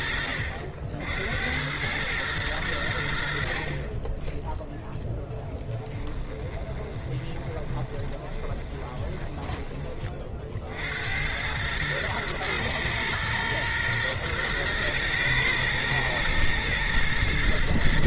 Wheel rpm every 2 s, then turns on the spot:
60, 80, 0, 20, 20, 80, 120, 120, 110.
6-10